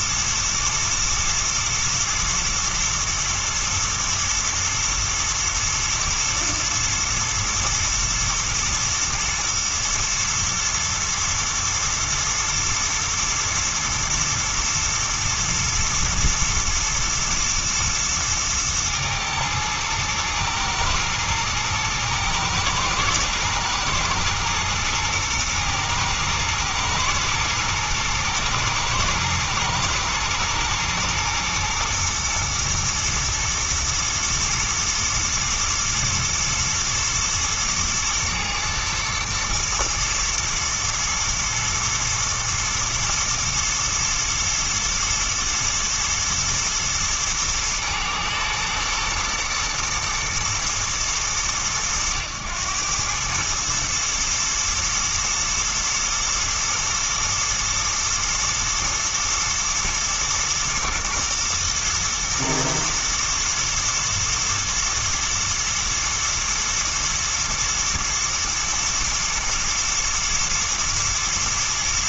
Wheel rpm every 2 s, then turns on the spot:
110, 110, 120, 110, 110, 110, 110, 110, 110, 110, 110, 110, 120, 110, 110, 110, 110, 120, 110, 110, 110, 120, 110, 110, 120, 110, 100, 110, 110, 110, 110, 110, 110, 120, 110, 110.
none